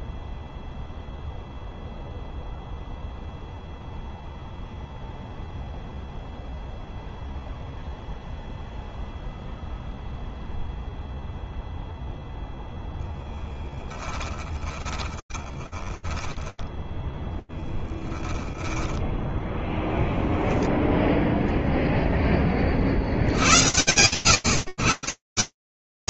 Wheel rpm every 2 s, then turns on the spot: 0, 0, 0, 0, 0, 0, 10, 20, 0, 0, 0, 80, 140.
12-16